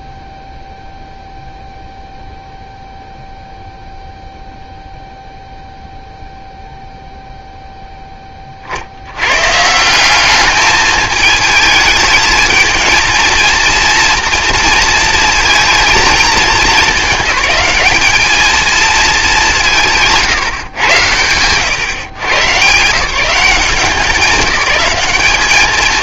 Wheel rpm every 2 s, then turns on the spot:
0, 0, 0, 0, 40, 210, 220, 230, 220, 220, 130, 120, 200.
none